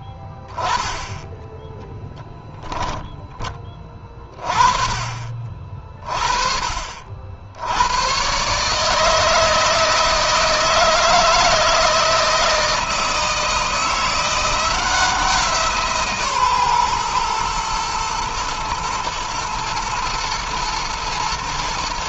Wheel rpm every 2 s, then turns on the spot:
10, 10, 40, 50, 150, 160, 160, 170, 130, 110, 120.
2-4